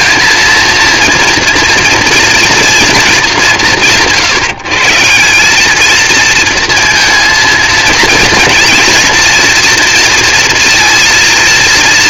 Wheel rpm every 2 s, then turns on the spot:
230, 230, 150, 230, 230, 230.
none